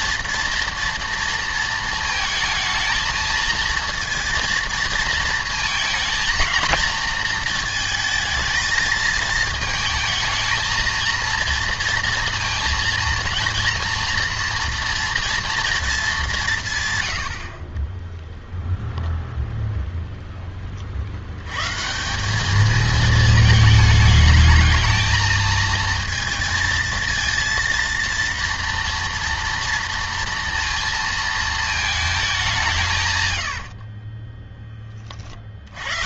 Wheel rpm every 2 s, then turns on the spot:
230, 220, 230, 230, 220, 230, 230, 230, 160, 0, 30, 220, 220, 230, 230, 230, 170, 20.
none